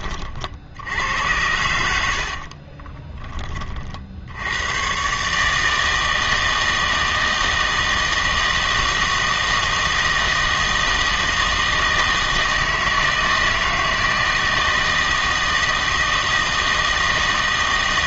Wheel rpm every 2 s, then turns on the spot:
60, 40, 110, 160, 160, 160, 160, 160, 160.
2-4